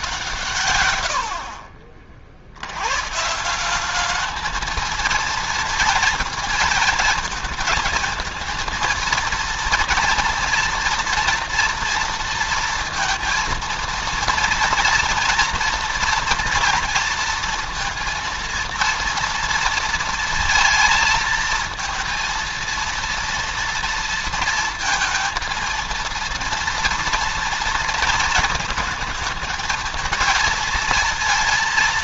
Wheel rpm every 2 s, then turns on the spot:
130, 100, 220, 220, 230, 230, 230, 230, 230, 230, 220, 230, 230, 230, 220, 230.
none